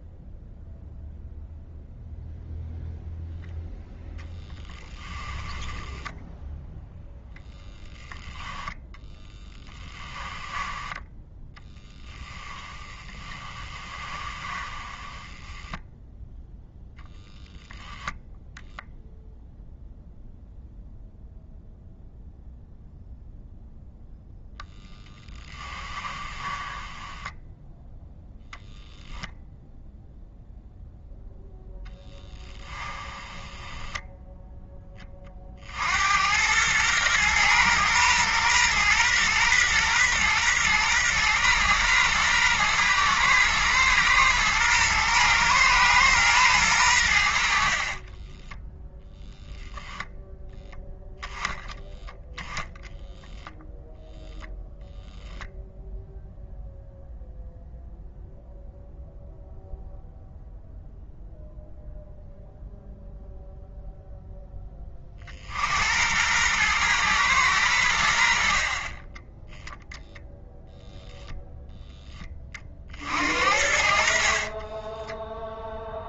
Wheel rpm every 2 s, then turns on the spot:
0, 0, 10, 0, 10, 10, 20, 10, 0, 0, 0, 0, 10, 10, 0, 0, 10, 30, 120, 120, 120, 120, 120, 80, 0, 0, 0, 0, 0, 0, 0, 0, 40, 110, 20, 0, 50, 10.
4-6 8-16 24-28 32-34 74-76